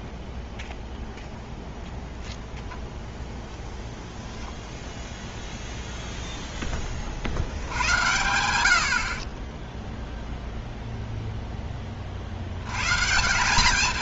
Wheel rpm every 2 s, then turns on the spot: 0, 0, 0, 0, 90, 0, 90.
none